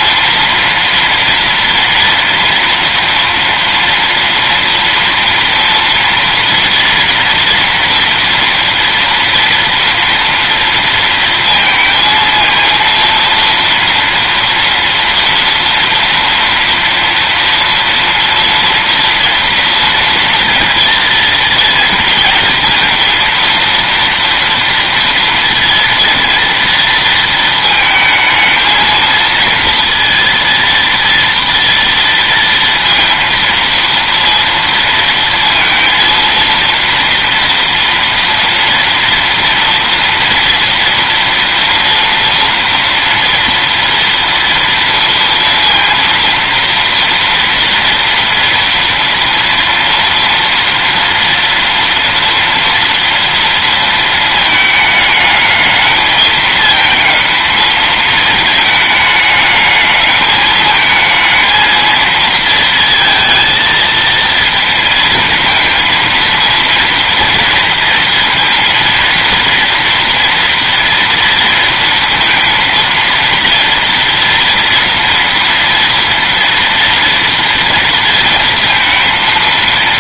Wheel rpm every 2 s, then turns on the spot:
230, 240, 230, 240, 240, 230, 230, 230, 230, 230, 230, 230, 230, 230, 220, 230, 230, 230, 230, 230, 240, 230, 230, 230, 230, 230, 230, 220, 220, 220, 220, 230, 230, 230, 230, 230, 230, 230, 230, 230.
none